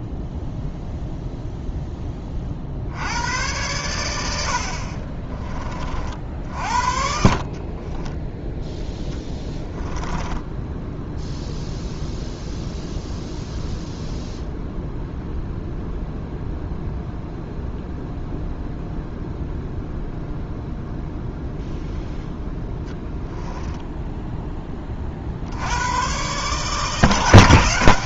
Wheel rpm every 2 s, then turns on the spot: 0, 70, 50, 50, 0, 10, 0, 0, 0, 0, 0, 10, 30, 150.
6-8